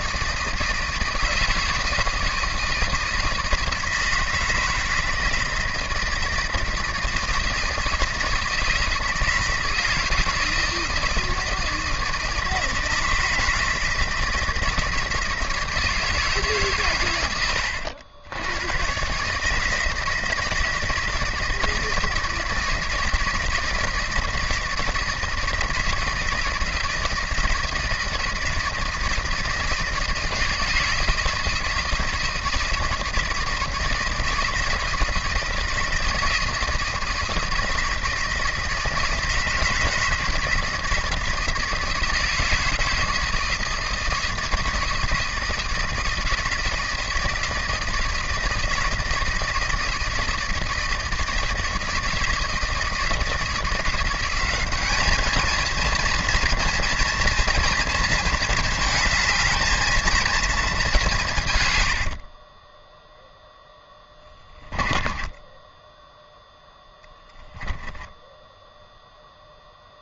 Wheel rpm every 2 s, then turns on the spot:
160, 160, 160, 160, 160, 170, 160, 160, 140, 110, 160, 160, 160, 160, 160, 160, 160, 160, 160, 160, 160, 160, 160, 160, 160, 160, 160, 200, 240, 220, 220, 20, 20, 0, 0.
62-66